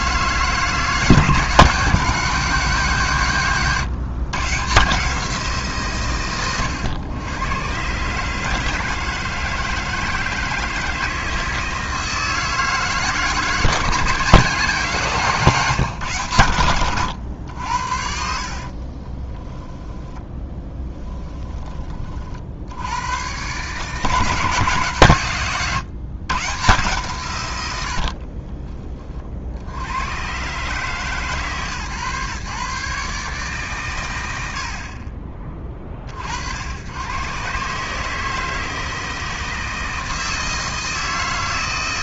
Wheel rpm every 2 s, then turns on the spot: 160, 180, 150, 110, 150, 160, 160, 160, 100, 50, 10, 70, 160, 130, 30, 130, 140, 70, 80, 160, 160.
18-22 28-30